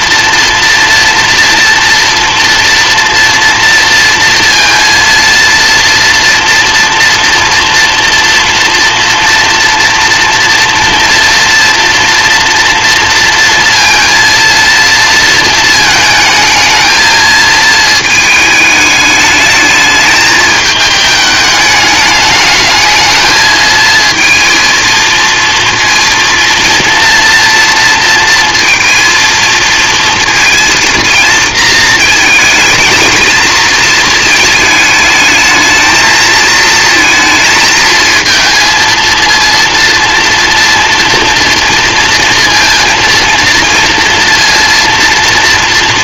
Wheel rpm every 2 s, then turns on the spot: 230, 230, 230, 230, 240, 230, 230, 230, 220, 210, 210, 210, 230, 230, 230, 230, 220, 220, 230, 230, 230, 230, 230.
none